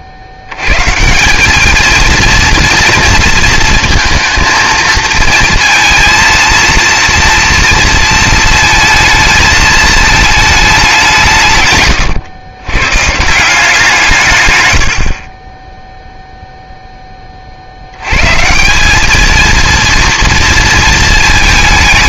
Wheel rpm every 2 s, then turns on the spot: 110, 230, 230, 230, 230, 210, 110, 100, 0, 180, 230.
none